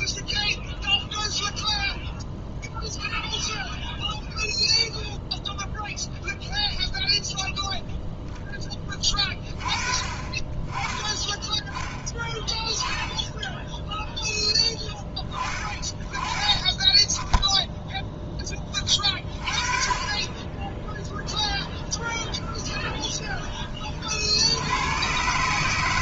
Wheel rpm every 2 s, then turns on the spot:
0, 0, 0, 0, 10, 20, 10, 10, 10, 40, 10, 20, 120.
22-24